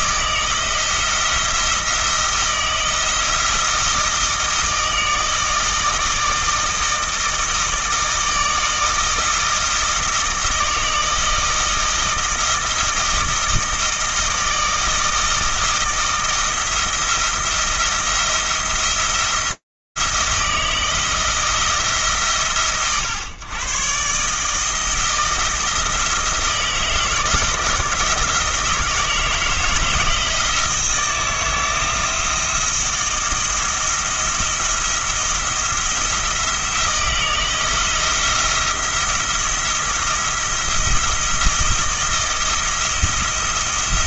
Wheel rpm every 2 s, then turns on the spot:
160, 170, 160, 160, 160, 160, 160, 160, 170, 170, 160, 120, 160, 170, 160, 170, 160, 170, 170, 170, 170, 170.
none